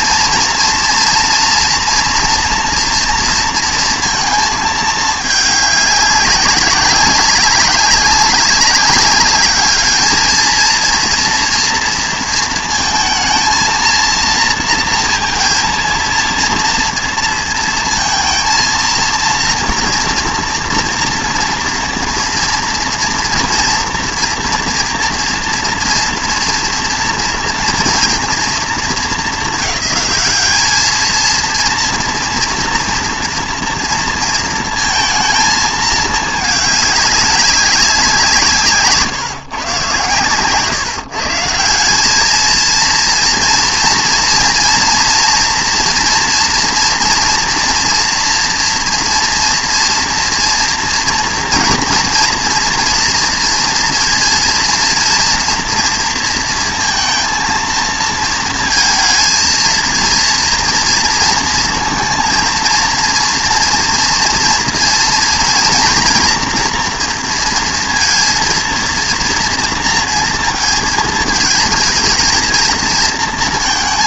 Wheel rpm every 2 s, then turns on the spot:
230, 230, 220, 190, 200, 230, 220, 230, 230, 230, 230, 230, 230, 230, 220, 210, 230, 220, 210, 150, 140, 220, 230, 230, 230, 230, 230, 230, 230, 230, 230, 230, 230, 230, 230, 230, 230.
none